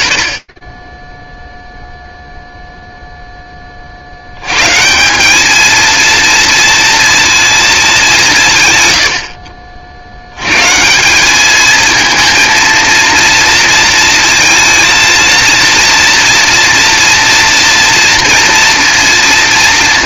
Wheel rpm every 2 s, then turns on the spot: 110, 0, 130, 230, 140, 130, 230, 230, 230, 230.
none